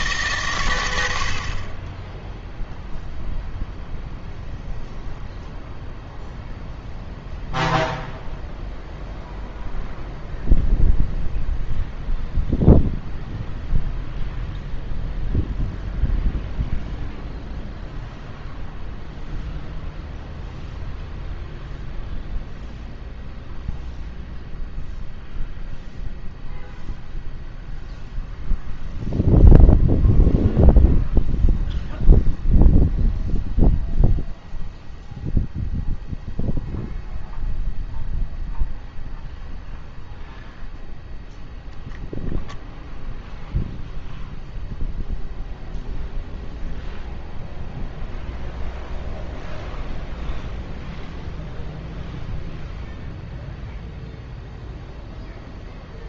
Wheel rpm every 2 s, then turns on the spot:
120, 0, 0, 0, 0, 0, 0, 0, 0, 0, 0, 0, 0, 0, 0, 0, 0, 0, 0, 0, 0, 0, 0, 0, 0, 0, 0, 0.
none